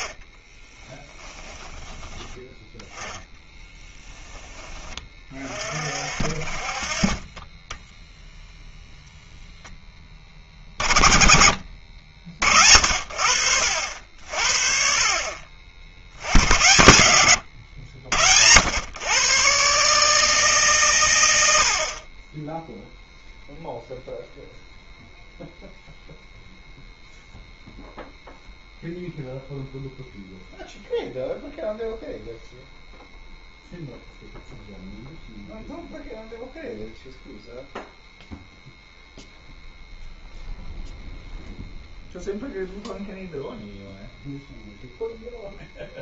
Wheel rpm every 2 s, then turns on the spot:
20, 10, 20, 40, 0, 30, 60, 50, 110, 100, 140, 10, 0, 0, 0, 0, 0, 0, 0, 0, 0, 0, 0.
0-2